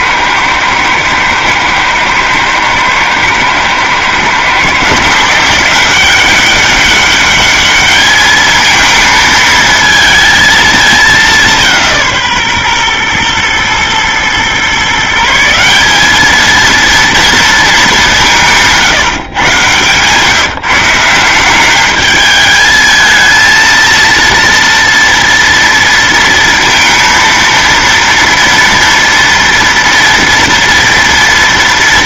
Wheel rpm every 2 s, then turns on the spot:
110, 110, 130, 190, 220, 220, 140, 130, 220, 170, 160, 220, 230, 230, 230, 230.
none